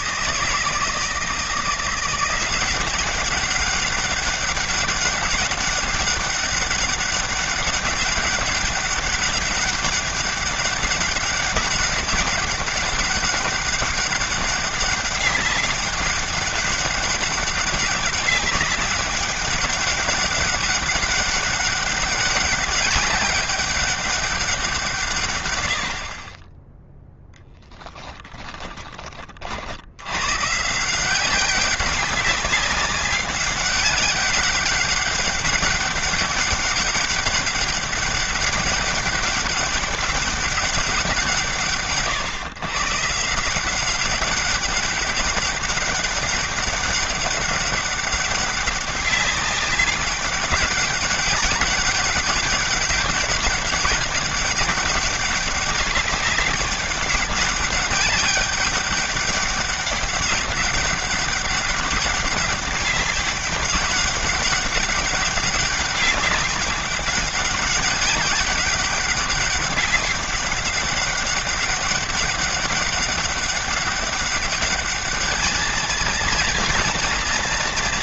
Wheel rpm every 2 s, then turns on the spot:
160, 190, 200, 200, 200, 200, 200, 200, 200, 200, 190, 200, 160, 10, 30, 170, 200, 200, 200, 200, 180, 150, 200, 200, 200, 200, 200, 200, 200, 200, 200, 200, 200, 200, 190, 200, 200, 210, 230.
none